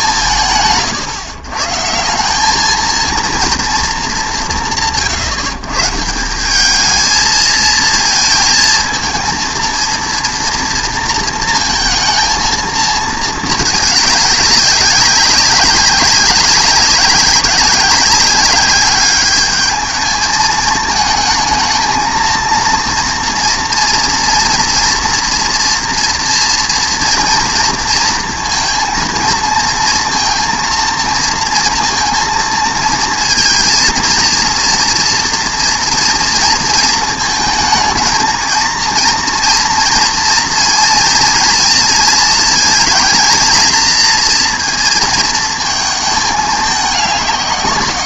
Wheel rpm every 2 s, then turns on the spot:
140, 210, 170, 210, 230, 230, 220, 200, 200, 200, 220, 230, 230, 230, 230, 230, 230, 230, 230, 230, 230, 230, 230, 210.
none